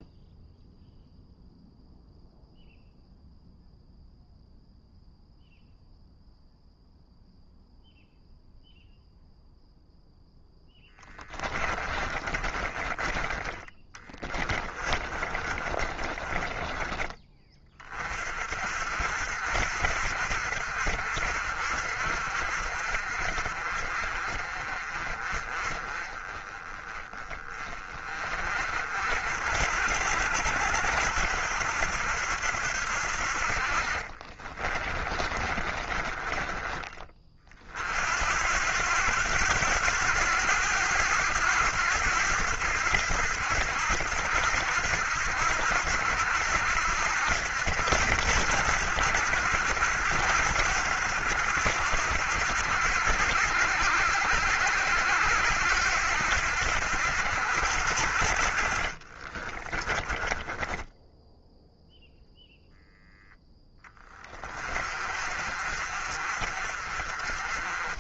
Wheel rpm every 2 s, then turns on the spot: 0, 0, 0, 0, 0, 20, 20, 30, 20, 60, 60, 50, 30, 20, 60, 70, 60, 30, 30, 90, 100, 80, 80, 80, 80, 80, 80, 80, 70, 40, 10, 0, 40, 40.
10-16 34-36 58-62